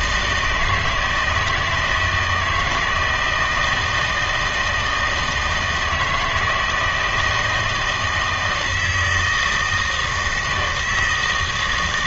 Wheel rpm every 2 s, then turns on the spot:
160, 170, 160, 160, 160, 160.
none